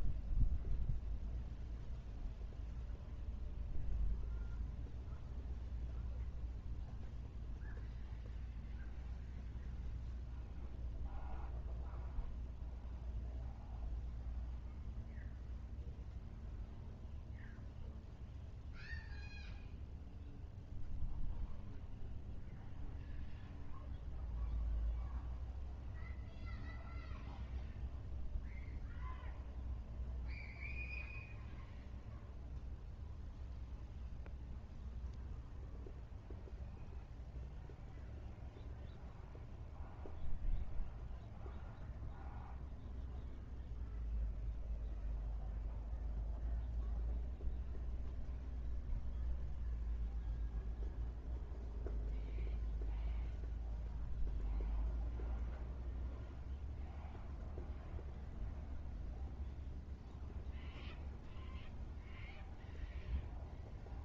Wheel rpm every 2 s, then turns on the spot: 0, 0, 0, 0, 0, 0, 0, 0, 0, 0, 0, 0, 0, 0, 0, 0, 0, 0, 0, 0, 0, 0, 0, 0, 0, 0, 0, 0, 0, 0, 0, 0.
none